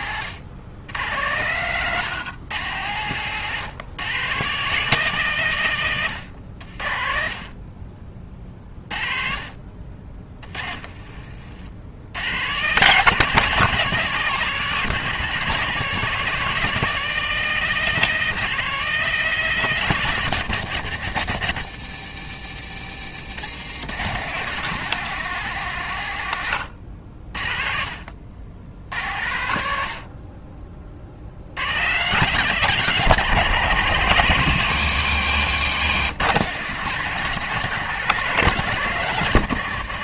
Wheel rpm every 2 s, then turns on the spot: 100, 120, 160, 50, 30, 40, 170, 170, 180, 180, 140, 120, 170, 70, 80, 40, 170, 130, 160, 150.
10-12 22-24